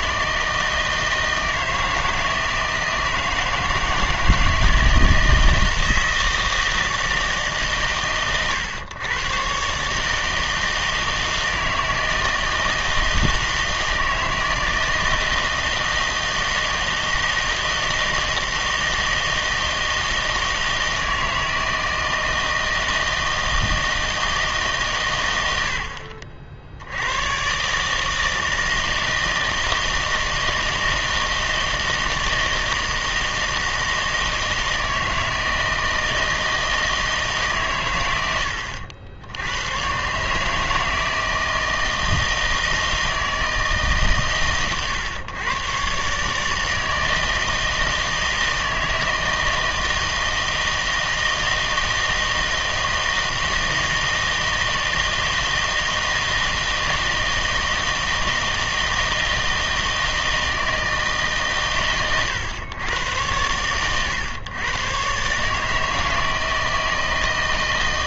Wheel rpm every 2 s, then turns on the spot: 160, 160, 160, 160, 120, 160, 160, 160, 160, 160, 160, 160, 150, 70, 160, 160, 160, 160, 160, 90, 150, 160, 120, 160, 160, 160, 160, 160, 160, 160, 160, 110, 120, 160.
none